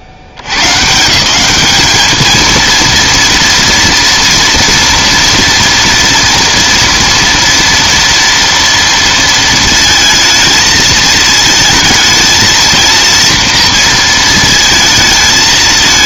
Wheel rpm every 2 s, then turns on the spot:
120, 230, 230, 230, 230, 220, 230, 220.
none